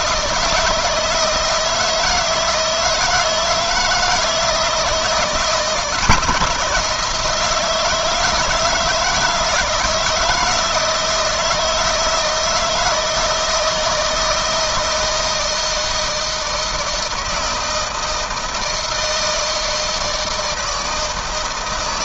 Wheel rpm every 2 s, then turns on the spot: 160, 160, 160, 170, 160, 160, 160, 160, 160, 160, 160.
none